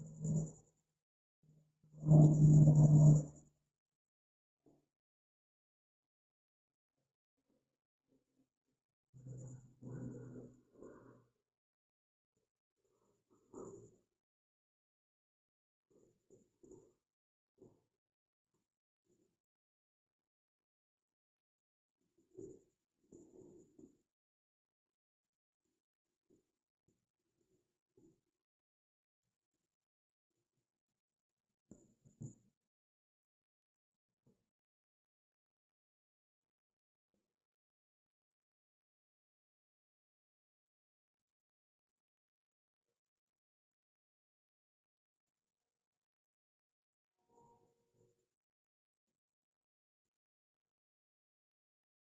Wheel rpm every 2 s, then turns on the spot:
0, 0, 0, 0, 0, 0, 0, 0, 0, 0, 0, 0, 0, 0, 0, 0, 0, 0, 0, 0, 0, 0, 0, 0, 0, 0.
none